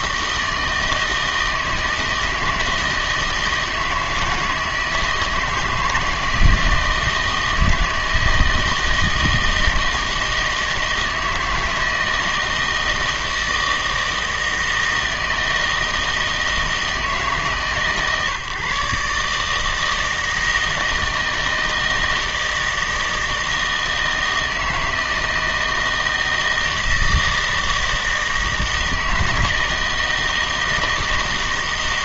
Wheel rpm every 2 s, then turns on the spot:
160, 160, 160, 160, 160, 160, 160, 160, 160, 150, 160, 160, 160, 160, 160, 160.
none